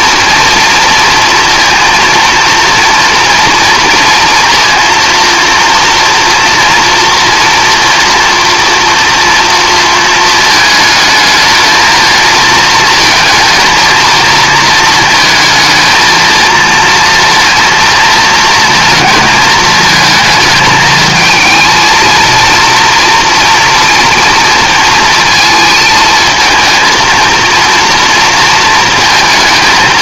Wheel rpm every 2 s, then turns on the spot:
230, 230, 230, 240, 230, 220, 230, 230, 230, 230, 220, 240, 230, 220, 230.
none